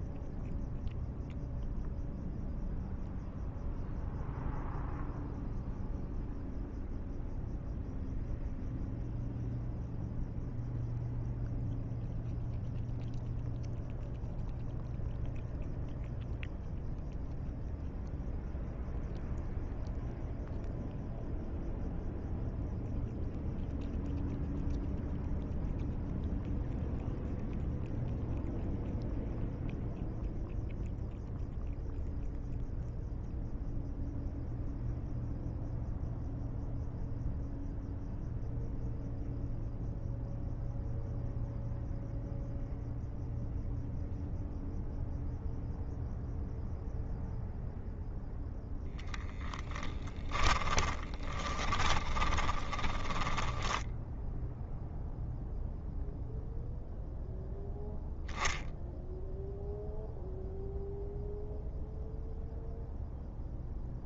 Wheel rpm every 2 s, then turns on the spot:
0, 0, 0, 0, 0, 0, 0, 0, 0, 0, 0, 0, 0, 0, 0, 0, 0, 0, 0, 0, 0, 0, 0, 0, 0, 20, 20, 0, 0, 0, 0, 0.
50-54